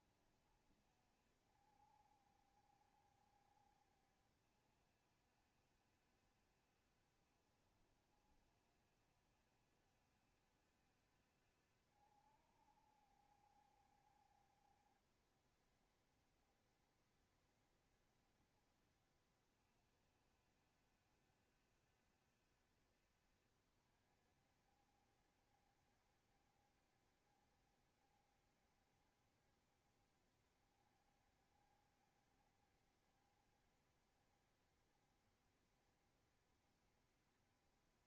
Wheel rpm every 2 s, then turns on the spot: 60, 60, 60, 60, 60, 60, 70, 60, 70, 70, 70, 60, 60, 70, 70, 70, 70, 70, 70.
none